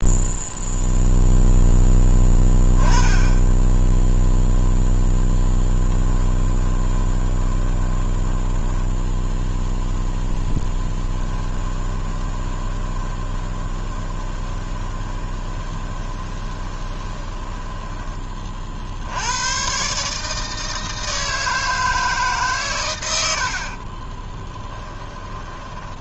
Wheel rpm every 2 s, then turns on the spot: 0, 10, 0, 20, 10, 10, 20, 20, 20, 50, 160, 120, 20.
6-8 10-18 24-26